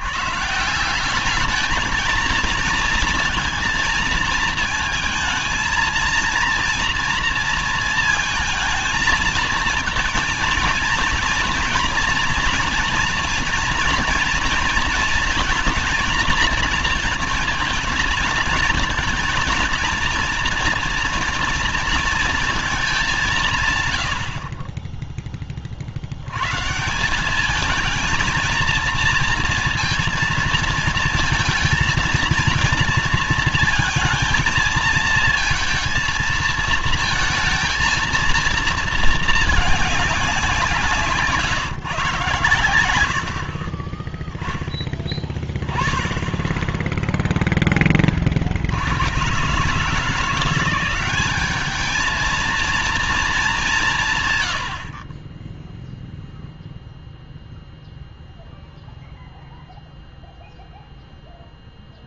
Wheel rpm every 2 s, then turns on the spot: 180, 230, 220, 230, 220, 230, 230, 220, 230, 230, 230, 200, 20, 160, 230, 230, 230, 220, 230, 230, 170, 90, 10, 0, 90, 180, 230, 60, 0, 0, 0.
none